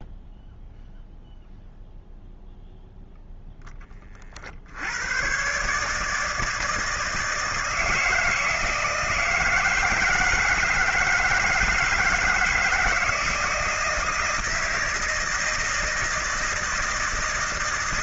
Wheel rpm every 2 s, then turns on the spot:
0, 0, 70, 160, 160, 160, 160, 160, 160.
none